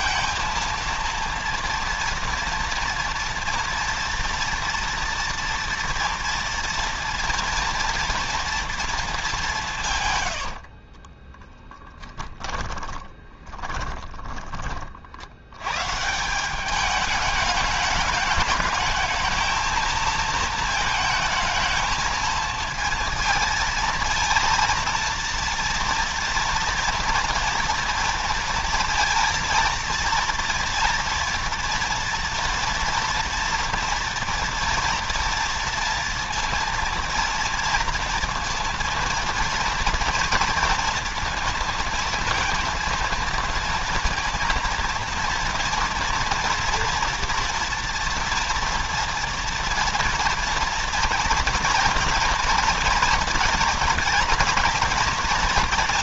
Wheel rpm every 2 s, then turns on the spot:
230, 230, 230, 230, 230, 60, 10, 30, 190, 220, 220, 230, 230, 230, 230, 240, 240, 230, 230, 230, 230, 230, 230, 230, 230, 230, 230, 240.
10-14